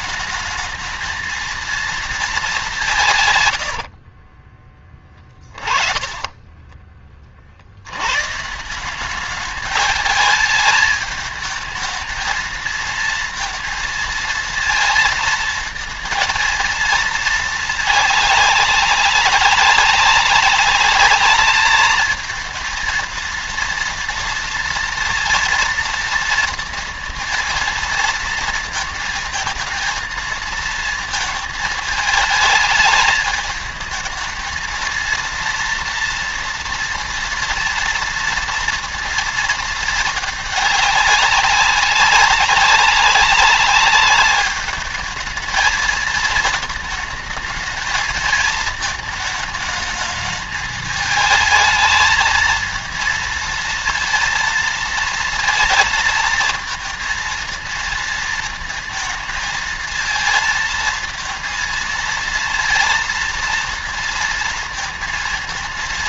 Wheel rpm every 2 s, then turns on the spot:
220, 200, 20, 20, 160, 220, 230, 230, 230, 210, 200, 220, 230, 230, 230, 230, 220, 220, 230, 230, 210, 200, 210, 220, 220, 210, 220, 220, 230, 230, 230, 230, 230.
4-8